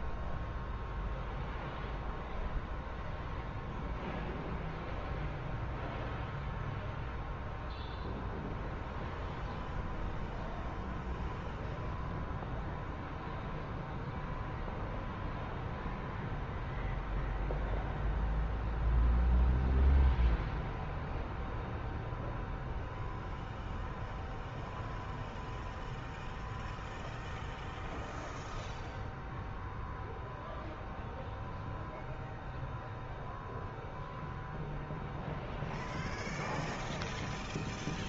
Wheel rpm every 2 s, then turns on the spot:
0, 0, 0, 0, 0, 0, 0, 0, 0, 0, 0, 0, 0, 0, 0, 0, 0, 0, 0.
none